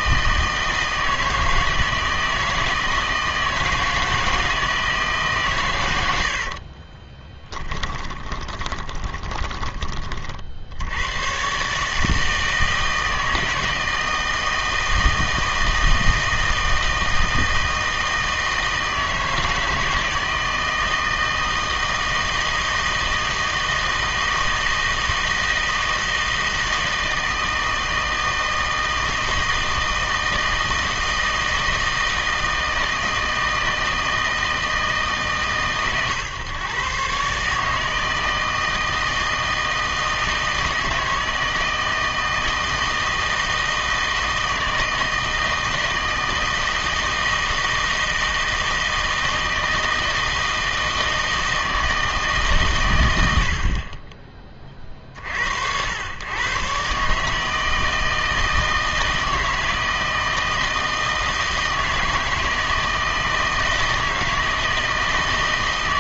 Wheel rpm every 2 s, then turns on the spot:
160, 160, 160, 50, 20, 60, 160, 160, 160, 160, 160, 160, 160, 160, 160, 160, 160, 160, 130, 160, 160, 160, 160, 160, 160, 160, 140, 30, 130, 160, 160, 160, 160.
6-10